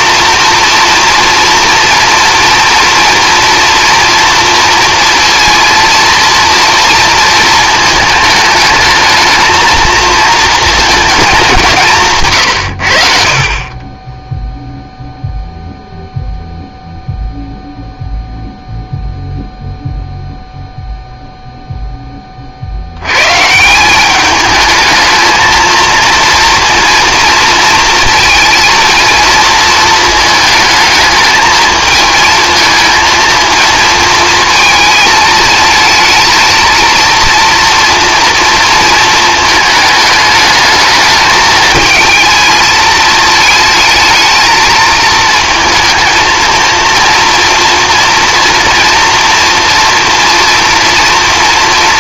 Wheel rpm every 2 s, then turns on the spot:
230, 230, 230, 230, 210, 220, 70, 0, 0, 0, 0, 90, 220, 230, 230, 220, 230, 220, 230, 220, 210, 220, 220, 230, 230, 230.
none